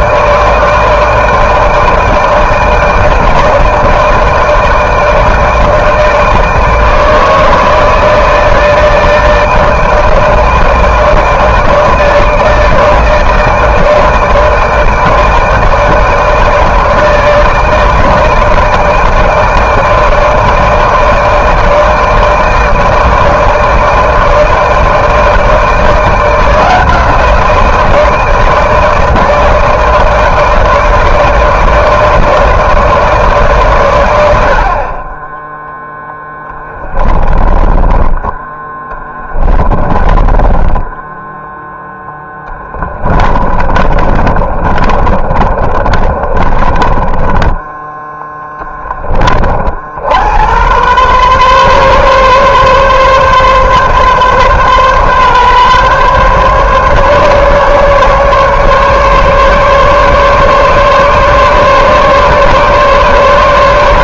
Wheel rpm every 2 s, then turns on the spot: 160, 160, 160, 160, 160, 160, 150, 160, 160, 160, 160, 160, 160, 160, 160, 160, 150, 60, 10, 10, 20, 10, 30, 30, 10, 90, 130, 130, 140, 140, 150, 150.
36-48